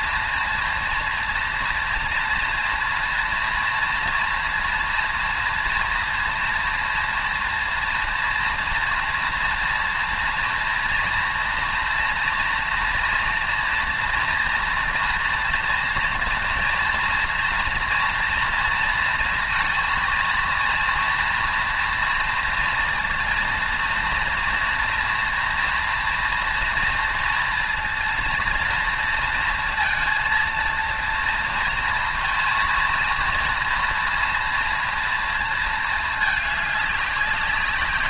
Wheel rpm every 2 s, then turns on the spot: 230, 230, 230, 230, 230, 230, 230, 230, 230, 230, 230, 230, 230, 230, 230, 230, 230, 230, 200.
none